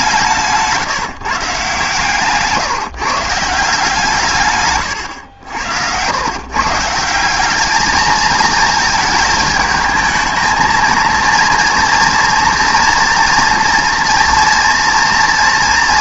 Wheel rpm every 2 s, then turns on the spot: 150, 150, 140, 150, 220, 220, 230, 230.
none